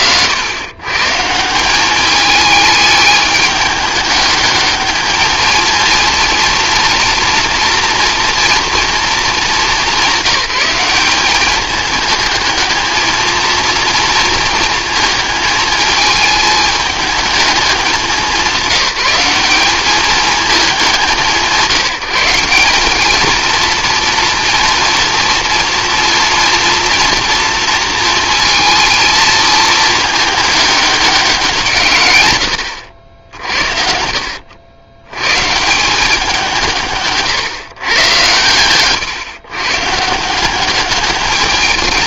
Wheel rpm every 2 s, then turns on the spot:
120, 210, 210, 230, 230, 200, 220, 230, 210, 190, 200, 200, 230, 230, 220, 210, 90, 80, 170, 120, 200.
38-40